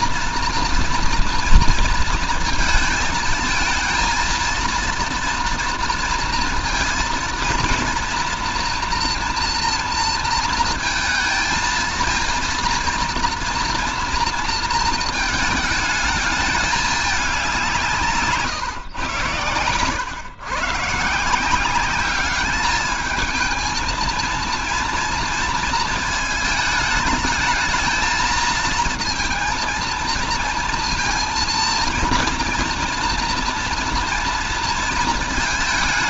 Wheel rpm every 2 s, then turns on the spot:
230, 220, 230, 230, 230, 230, 230, 220, 210, 140, 140, 210, 230, 220, 230, 230, 240, 230.
none